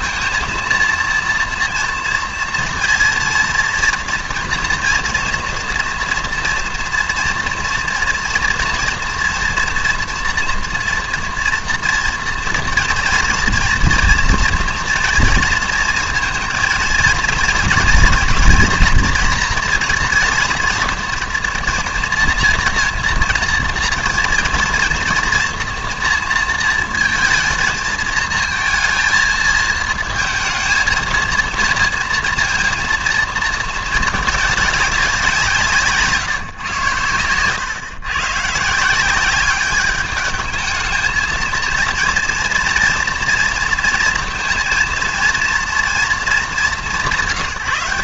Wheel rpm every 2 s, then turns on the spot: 230, 230, 230, 230, 230, 230, 230, 230, 220, 240, 230, 230, 230, 230, 230, 230, 230, 210, 130, 150, 220, 230, 230, 200.
none